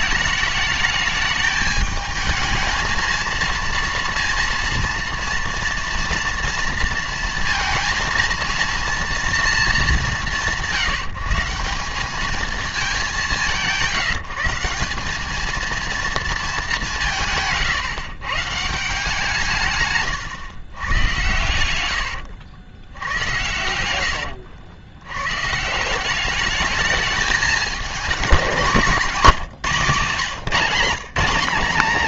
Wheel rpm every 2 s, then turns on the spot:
210, 220, 230, 230, 230, 170, 220, 170, 200, 150, 110, 80, 80, 210, 200, 180.
none